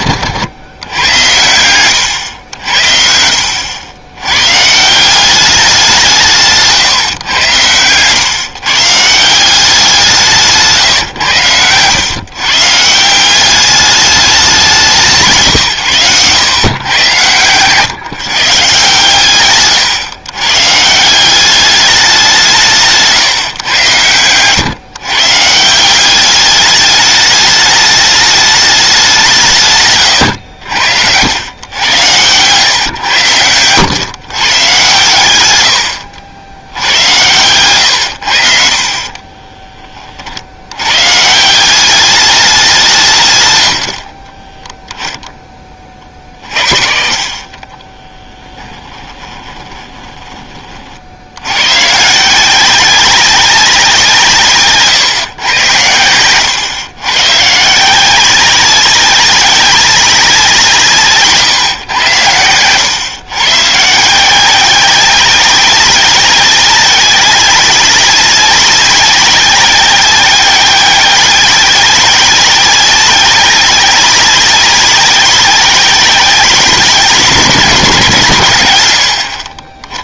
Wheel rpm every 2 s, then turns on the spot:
90, 80, 130, 160, 140, 160, 140, 190, 110, 140, 130, 170, 110, 200, 210, 90, 130, 130, 90, 70, 70, 190, 20, 50, 20, 30, 180, 150, 110, 190, 180, 110, 180, 190, 200, 190, 190, 190, 190, 120.
0-2 10-12 44-50